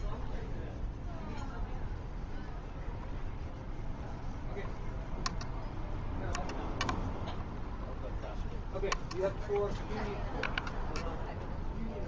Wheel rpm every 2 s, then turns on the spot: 0, 0, 0, 0, 0, 0.
none